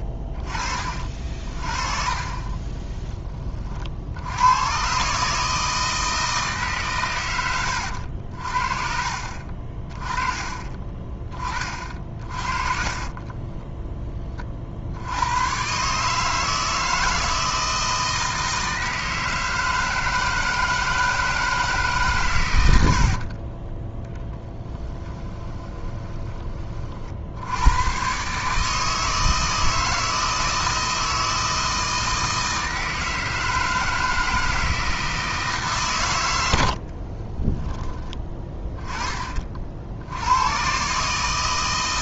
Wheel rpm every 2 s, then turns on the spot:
30, 20, 110, 150, 50, 20, 40, 50, 160, 160, 160, 100, 10, 30, 150, 160, 160, 160, 90, 10, 110.
12-14 24-26 38-40